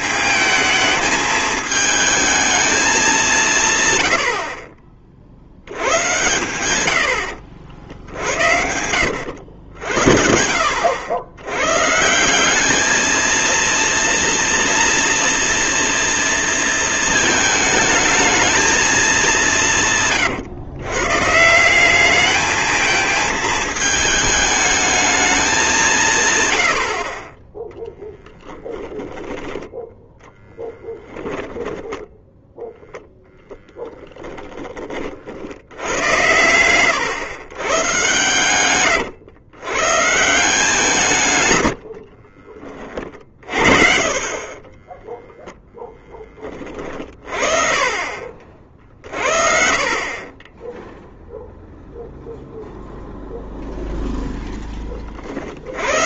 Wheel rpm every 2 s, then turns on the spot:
220, 210, 50, 90, 80, 80, 210, 230, 230, 210, 130, 220, 220, 70, 10, 10, 0, 30, 110, 120, 160, 30, 20, 30, 50, 0, 0, 20.
30-32 44-46